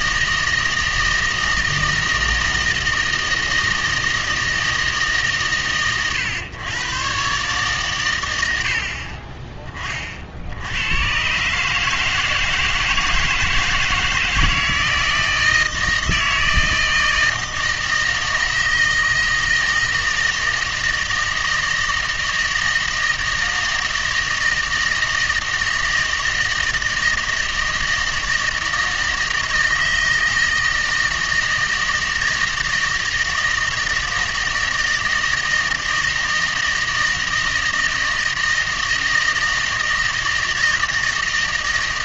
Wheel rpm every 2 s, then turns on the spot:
160, 160, 160, 110, 60, 90, 160, 160, 160, 160, 160, 160, 160, 160, 160, 160, 160, 160, 160, 160, 160.
none